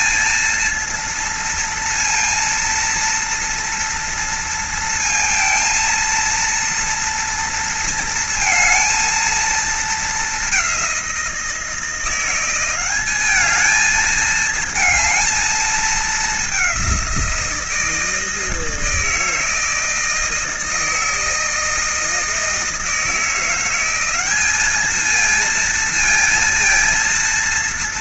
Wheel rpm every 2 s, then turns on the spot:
230, 230, 230, 230, 230, 200, 190, 220, 190, 160, 160, 160, 210, 230.
none